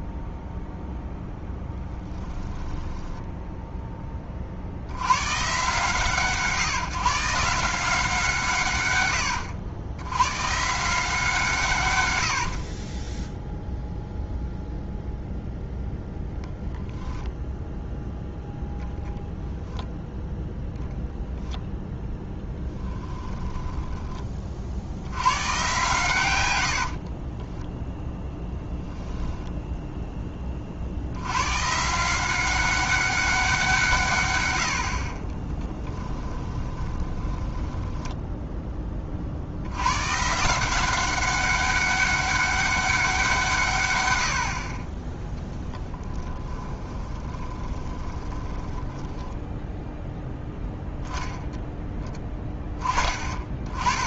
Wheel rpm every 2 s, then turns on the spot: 0, 10, 50, 140, 110, 160, 30, 0, 0, 10, 0, 10, 60, 70, 0, 50, 190, 70, 20, 10, 170, 200, 40, 20, 10, 0, 10.
12-14 22-24 36-38 46-50